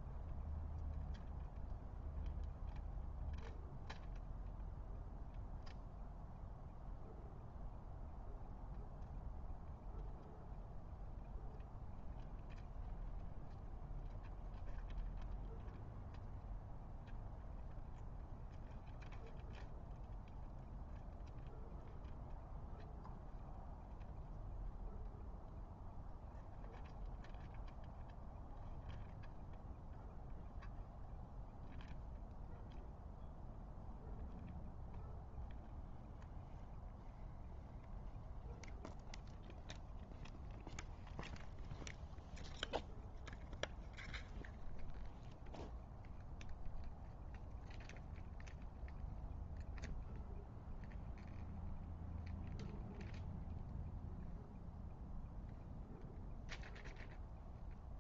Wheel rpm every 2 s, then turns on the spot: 0, 0, 0, 0, 0, 0, 0, 0, 0, 0, 0, 0, 0, 0, 0, 0, 0, 0, 0, 0, 0, 0, 0, 0, 0, 0, 0, 0, 0.
none